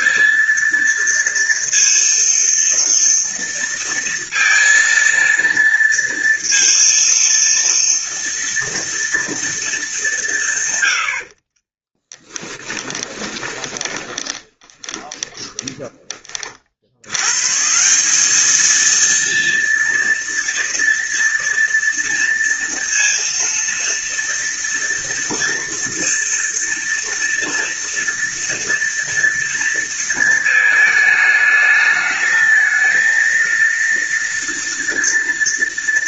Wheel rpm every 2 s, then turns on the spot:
230, 230, 230, 230, 230, 110, 10, 20, 60, 220, 230, 230, 230, 230, 230, 220, 220, 230.
12-16